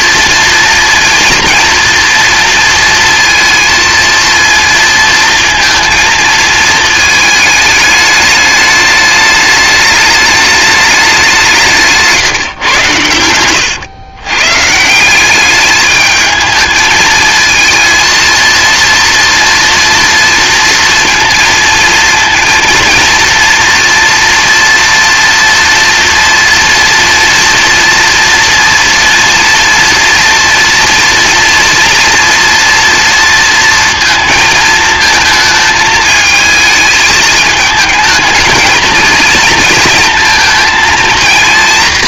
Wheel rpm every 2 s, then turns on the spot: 230, 230, 230, 220, 210, 200, 110, 160, 220, 230, 230, 230, 240, 230, 230, 230, 230, 220, 220, 220, 230.
none